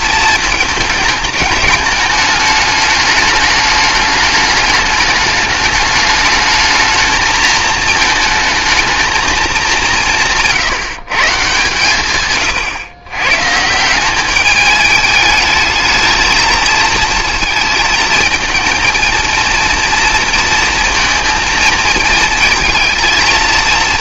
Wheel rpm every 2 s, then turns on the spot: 220, 210, 210, 220, 220, 160, 120, 210, 220, 230, 230, 230.
none